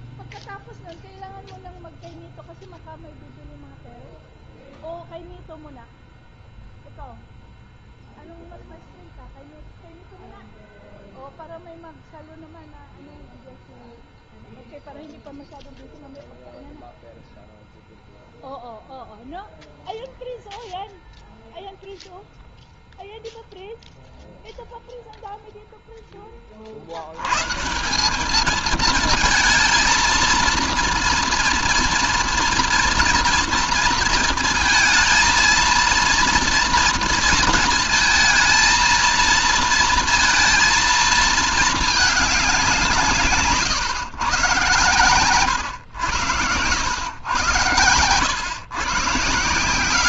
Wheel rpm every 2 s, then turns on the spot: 0, 0, 0, 0, 0, 0, 0, 0, 0, 0, 0, 0, 0, 40, 210, 230, 240, 230, 230, 220, 230, 180, 120, 120, 110.
none